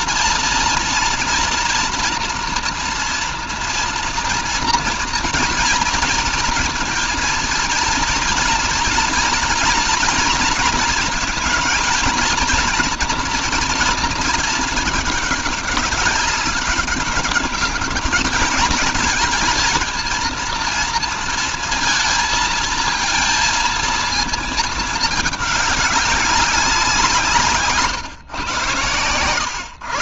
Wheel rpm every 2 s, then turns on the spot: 230, 230, 230, 230, 230, 230, 230, 220, 200, 220, 230, 230, 220, 190, 130.
none